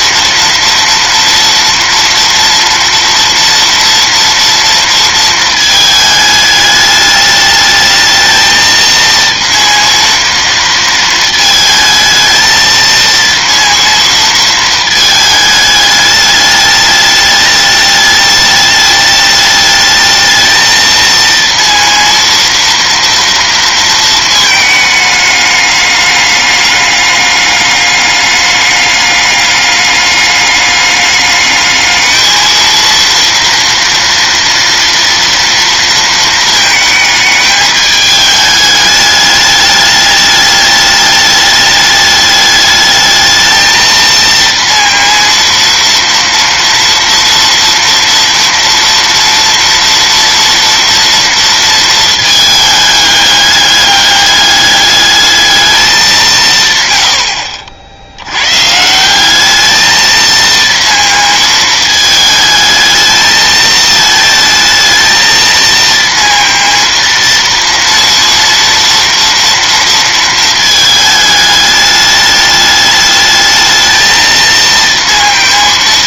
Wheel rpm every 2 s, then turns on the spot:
230, 230, 230, 210, 220, 230, 220, 220, 210, 210, 220, 230, 220, 210, 200, 200, 230, 230, 220, 210, 210, 210, 230, 230, 230, 230, 220, 200, 160, 110, 230, 220, 220, 230, 230, 220, 210, 230.
none